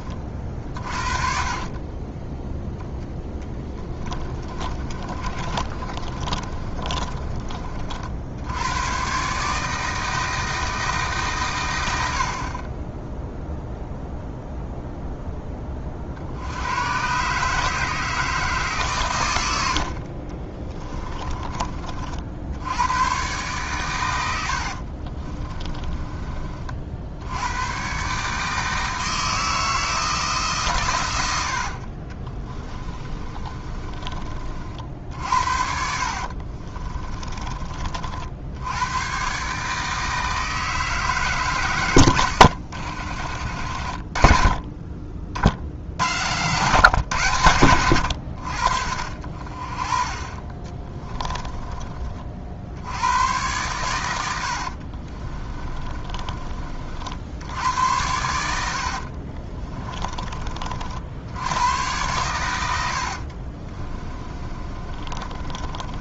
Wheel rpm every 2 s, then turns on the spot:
60, 10, 40, 30, 110, 160, 20, 0, 100, 140, 20, 100, 50, 50, 160, 110, 30, 50, 30, 90, 160, 80, 30, 130, 60, 20, 80, 40, 50, 70, 60, 90, 30.
4-8 20-22 24-26 32-34 36-38 42-44 50-52 54-56 58-60 62-66